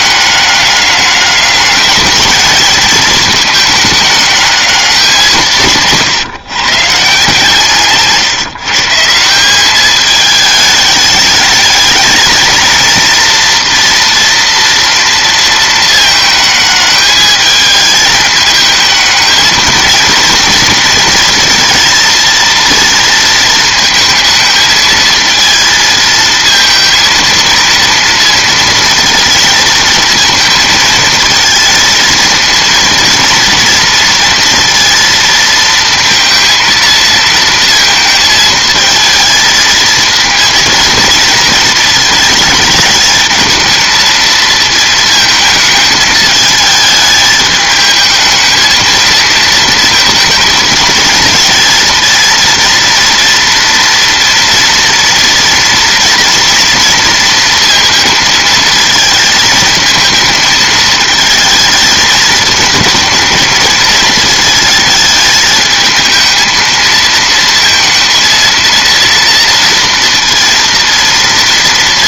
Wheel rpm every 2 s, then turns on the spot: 200, 210, 190, 150, 150, 210, 230, 230, 210, 220, 230, 230, 220, 230, 220, 220, 230, 230, 230, 220, 230, 220, 220, 210, 220, 220, 230, 230, 230, 230, 220, 220, 220, 220, 230, 230.
none